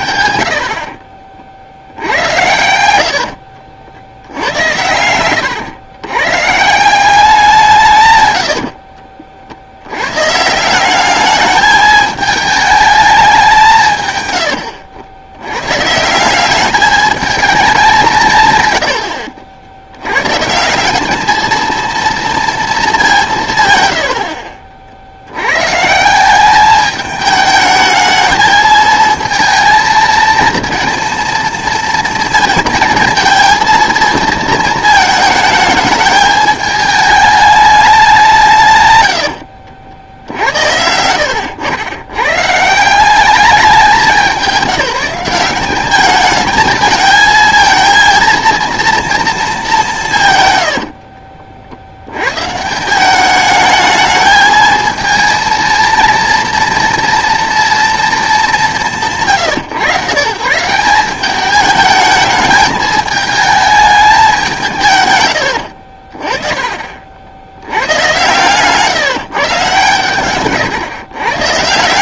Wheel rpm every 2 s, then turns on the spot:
70, 90, 90, 160, 80, 160, 220, 90, 200, 150, 160, 220, 50, 200, 220, 230, 230, 220, 220, 150, 80, 150, 190, 220, 230, 120, 130, 220, 230, 210, 150, 210, 180, 30, 130, 130.
2-4 8-10 68-70